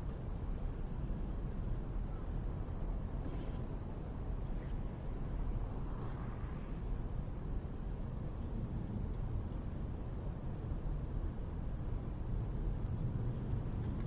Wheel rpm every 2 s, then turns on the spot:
0, 0, 0, 0, 0, 0, 0.
none